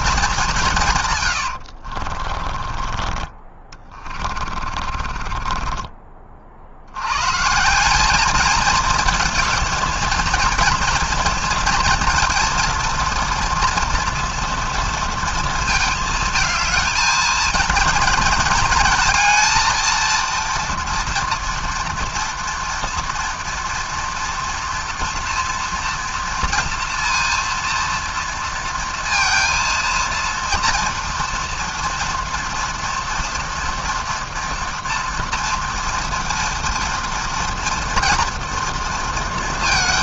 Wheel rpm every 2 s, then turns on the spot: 180, 30, 40, 50, 220, 230, 230, 230, 220, 230, 230, 230, 230, 230, 230, 230, 230, 240, 230, 230.
2-6